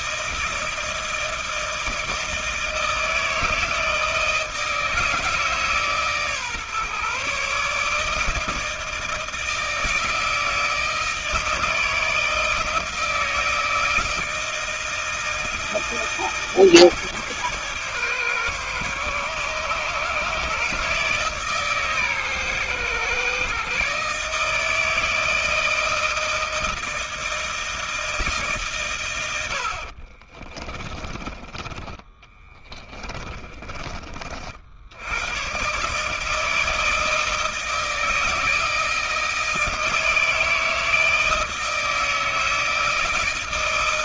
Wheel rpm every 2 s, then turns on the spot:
160, 160, 160, 140, 160, 160, 160, 160, 150, 130, 150, 130, 160, 160, 130, 30, 20, 80, 160, 160, 160, 160.
30-34